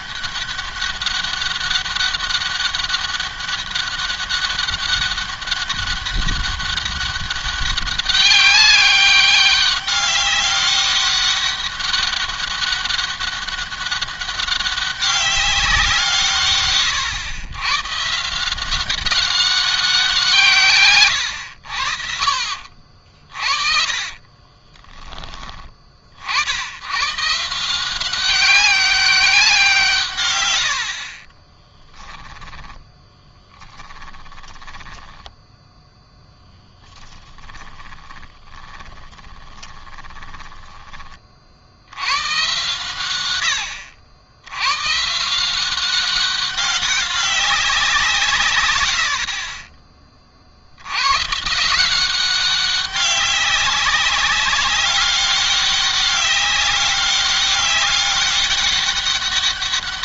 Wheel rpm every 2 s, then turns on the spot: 200, 200, 200, 200, 200, 200, 200, 200, 130, 180, 130, 50, 30, 100, 200, 70, 10, 10, 10, 20, 20, 120, 120, 200, 90, 80, 190, 200, 200, 200.
20-22 24-26 32-40 48-50